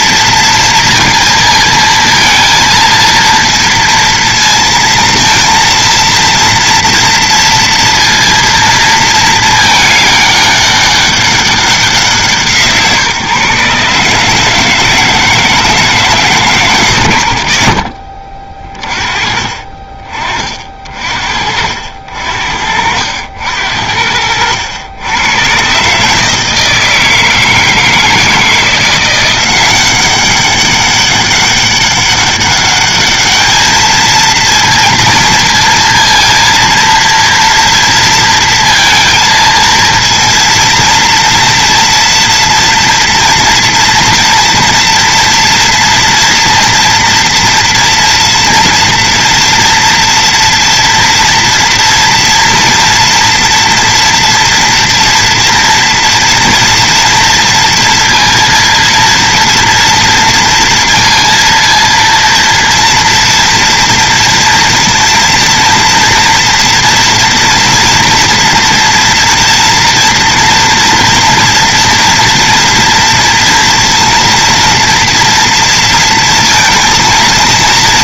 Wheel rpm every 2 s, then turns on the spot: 230, 230, 230, 230, 230, 200, 170, 150, 150, 40, 40, 60, 80, 160, 160, 190, 200, 220, 230, 230, 230, 230, 230, 230, 230, 230, 230, 230, 230, 230, 230, 230, 230, 240, 230, 230, 230, 230, 230.
none